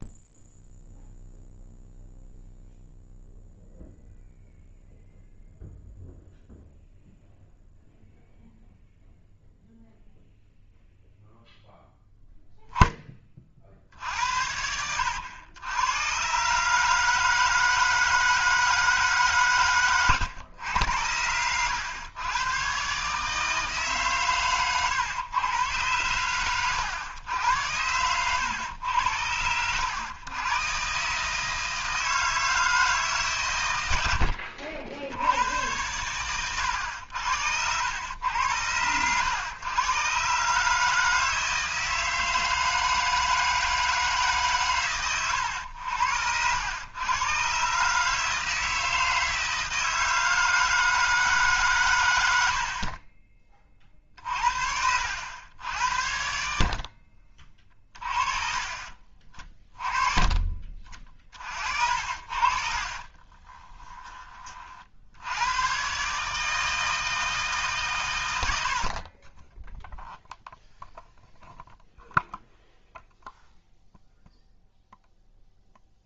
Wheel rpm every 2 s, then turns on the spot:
0, 0, 0, 0, 0, 0, 10, 90, 150, 150, 100, 130, 110, 110, 90, 140, 150, 70, 80, 110, 150, 160, 120, 110, 160, 160, 40, 70, 50, 40, 40, 40, 60, 160, 50, 0, 0, 0.
62-64